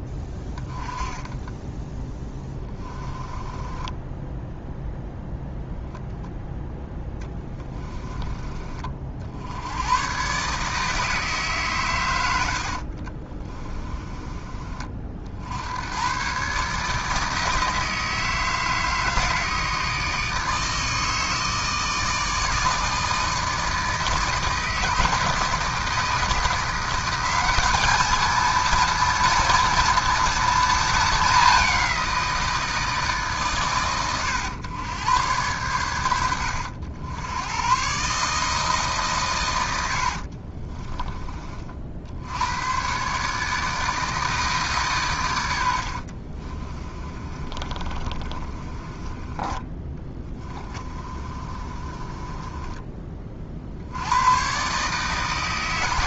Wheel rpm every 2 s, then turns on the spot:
10, 20, 0, 10, 40, 150, 60, 40, 150, 160, 160, 160, 160, 170, 230, 230, 160, 110, 80, 150, 40, 120, 140, 30, 30, 30, 20, 140.
0-4 12-14 40-42 46-54